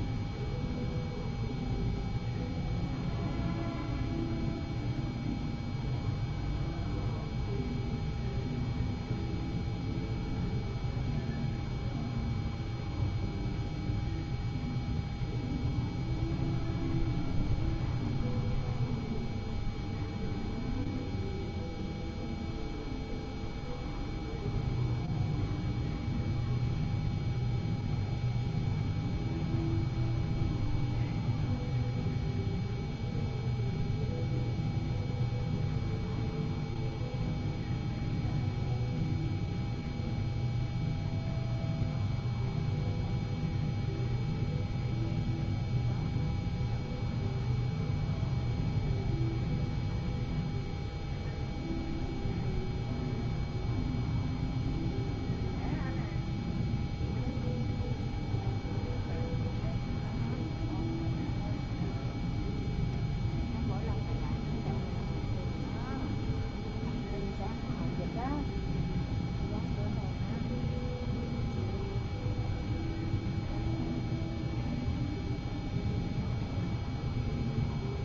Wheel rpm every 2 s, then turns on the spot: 0, 0, 0, 0, 0, 0, 0, 0, 0, 0, 0, 0, 0, 0, 0, 0, 0, 0, 0, 0, 0, 0, 0, 0, 0, 0, 0, 0, 0, 0, 0, 0, 0, 0, 0, 0, 0, 0, 0.
none